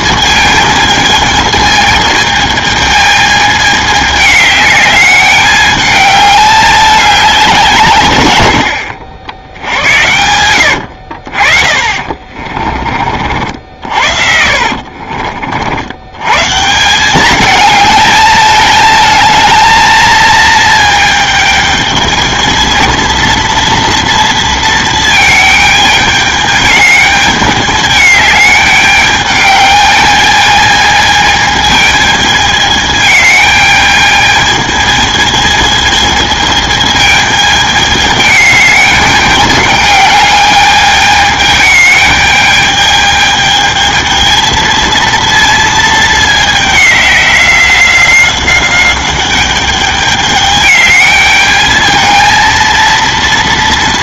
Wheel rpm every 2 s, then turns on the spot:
220, 220, 210, 200, 70, 70, 40, 50, 170, 220, 220, 220, 230, 210, 210, 220, 210, 220, 220, 210, 210, 210, 230, 200, 190, 210, 230.
10-12 14-16